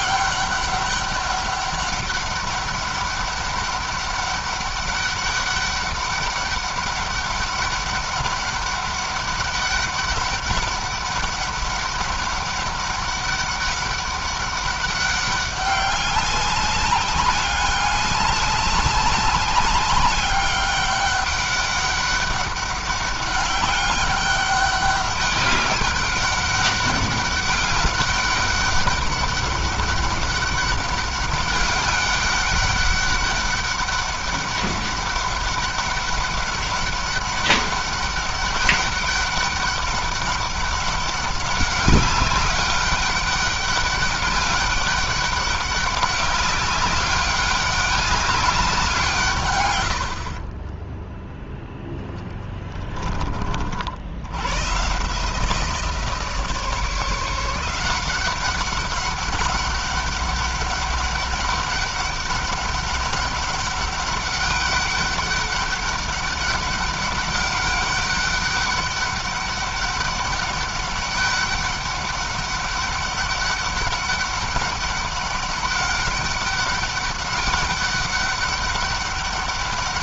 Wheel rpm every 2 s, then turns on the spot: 200, 200, 200, 200, 200, 200, 200, 200, 200, 200, 200, 200, 200, 190, 200, 200, 200, 200, 200, 200, 200, 200, 200, 200, 160, 10, 20, 140, 160, 190, 200, 200, 200, 200, 200, 200, 200, 200, 190, 200.
50-52